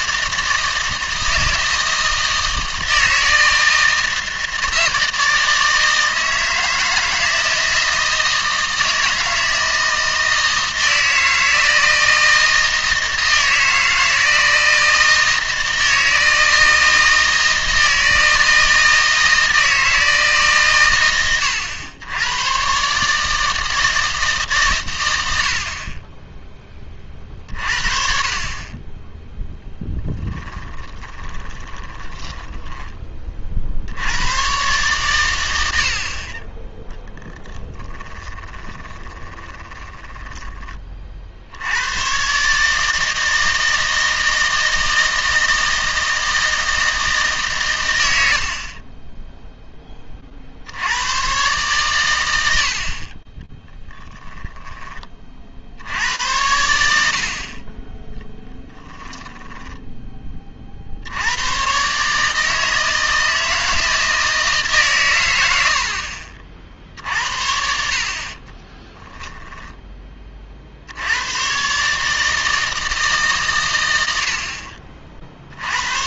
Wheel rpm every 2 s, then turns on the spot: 160, 160, 160, 160, 160, 160, 160, 160, 160, 160, 120, 130, 130, 20, 20, 20, 20, 130, 10, 20, 30, 150, 160, 160, 40, 80, 60, 10, 80, 10, 50, 160, 140, 50, 10, 70, 160, 50.
30-34 38-40 58-60 68-70